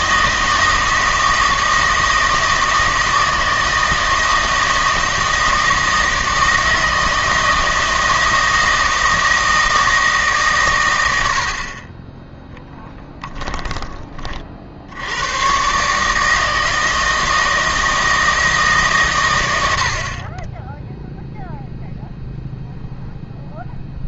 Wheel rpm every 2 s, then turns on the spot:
160, 160, 160, 160, 160, 130, 0, 50, 160, 150, 10, 0.
none